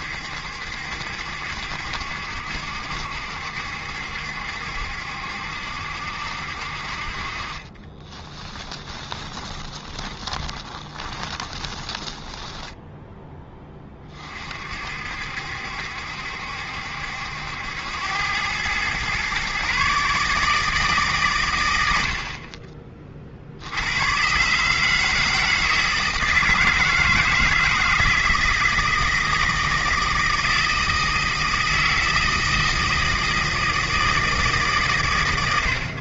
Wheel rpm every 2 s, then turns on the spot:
70, 70, 70, 50, 20, 20, 10, 60, 70, 120, 150, 30, 160, 160, 160, 160, 160, 130.
8-12